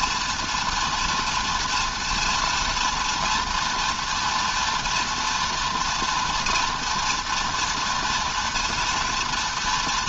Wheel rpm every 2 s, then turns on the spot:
240, 230, 230, 240, 230.
none